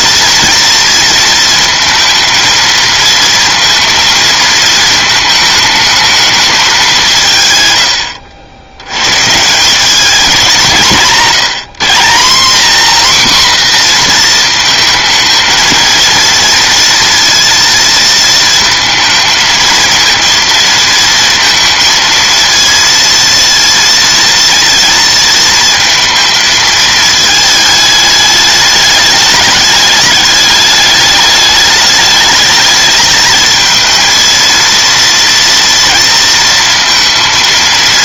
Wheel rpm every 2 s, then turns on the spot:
230, 220, 220, 210, 80, 190, 230, 230, 230, 220, 230, 230, 230, 220, 210, 210, 220, 230, 230.
none